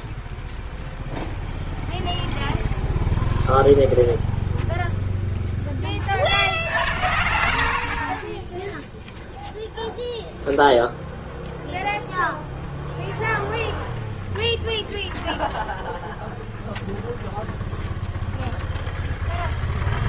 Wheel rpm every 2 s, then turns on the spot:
0, 0, 0, 60, 10, 0, 0, 0, 0, 0.
6-8